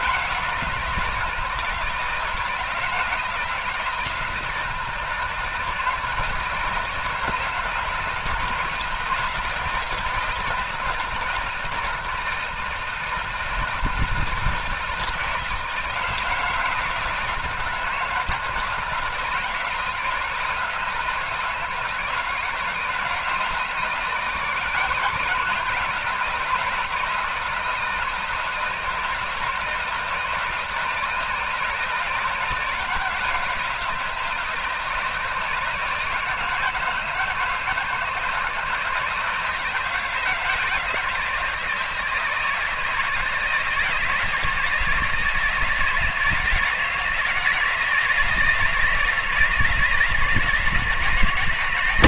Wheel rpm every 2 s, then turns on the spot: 160, 160, 160, 160, 160, 170, 160, 160, 160, 160, 160, 160, 160, 160, 160, 160, 170, 160, 160, 170, 160, 160, 160, 160, 160, 160.
none